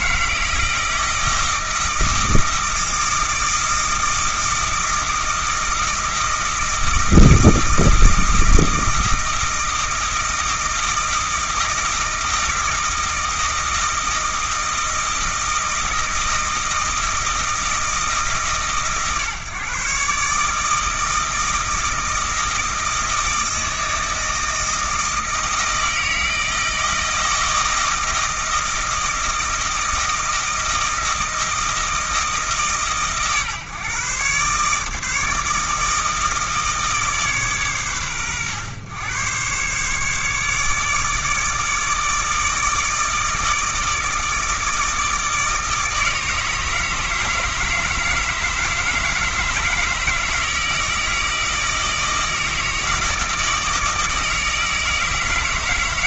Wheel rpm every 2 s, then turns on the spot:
160, 160, 160, 160, 160, 160, 160, 160, 160, 150, 160, 160, 160, 160, 160, 160, 150, 150, 160, 110, 150, 160, 160, 150, 160, 160, 160, 160.
none